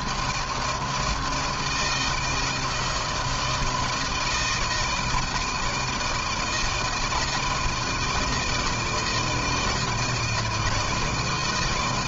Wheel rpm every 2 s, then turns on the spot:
160, 160, 160, 160, 170, 160.
none